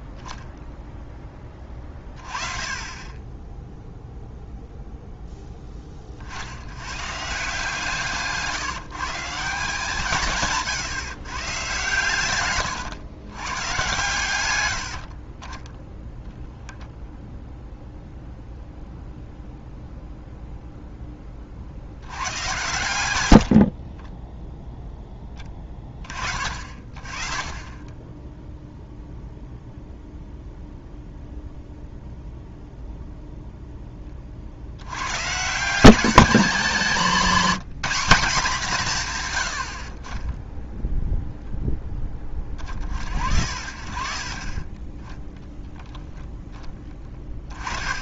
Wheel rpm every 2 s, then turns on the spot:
0, 20, 0, 130, 160, 130, 120, 60, 0, 0, 10, 100, 10, 40, 0, 0, 0, 100, 210, 170, 0, 40, 20, 10.
14-16 22-24 46-48